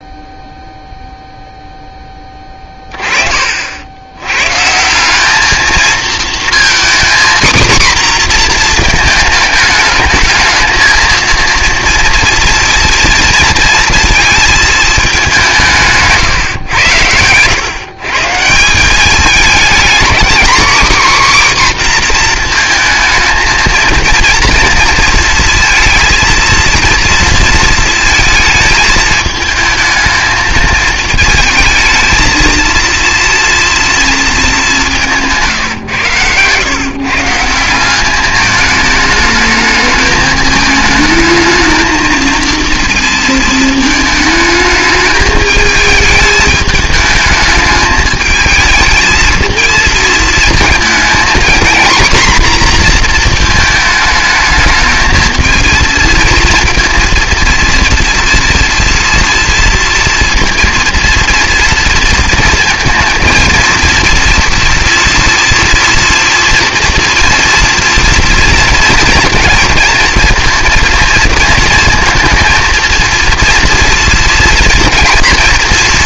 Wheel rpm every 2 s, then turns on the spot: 0, 30, 170, 240, 230, 220, 230, 220, 110, 190, 260, 230, 230, 230, 220, 220, 230, 190, 140, 210, 220, 230, 210, 210, 220, 230, 240, 220, 230, 230, 230, 220, 230, 240, 230, 230, 230, 230.
none